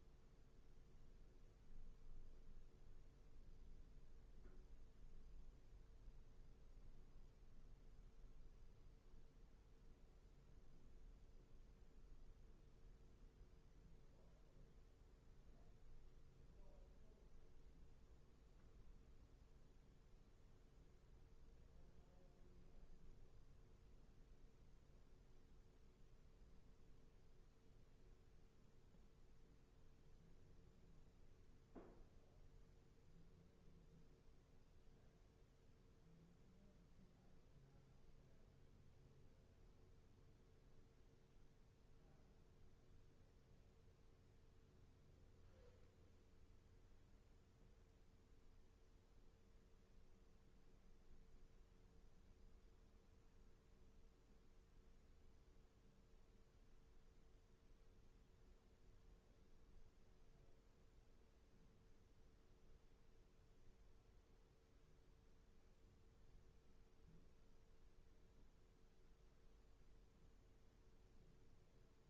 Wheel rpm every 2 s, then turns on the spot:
0, 0, 0, 0, 0, 0, 0, 0, 0, 0, 0, 0, 0, 0, 0, 0, 0, 0, 0, 0, 0, 0, 0, 0, 0, 0, 0, 0, 0, 0, 0, 0, 0, 0, 0, 0.
none